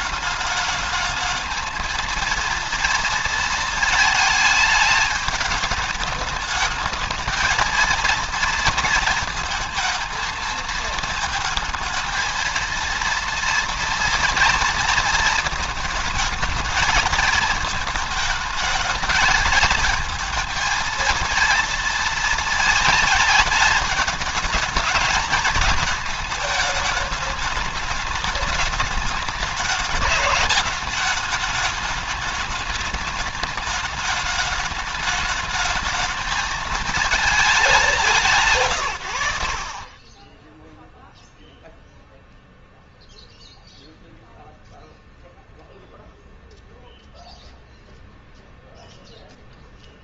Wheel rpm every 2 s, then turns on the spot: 210, 230, 210, 220, 230, 220, 230, 230, 220, 210, 230, 220, 220, 220, 210, 210, 210, 210, 220, 120, 0, 0, 0, 0, 0.
none